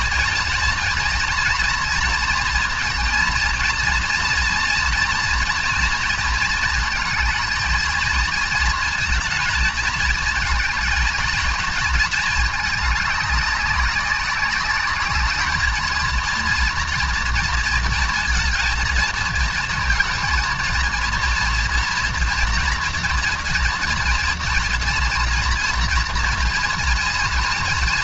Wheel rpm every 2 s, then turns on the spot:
220, 230, 230, 230, 230, 220, 210, 200, 230, 220, 230, 230, 240, 230.
none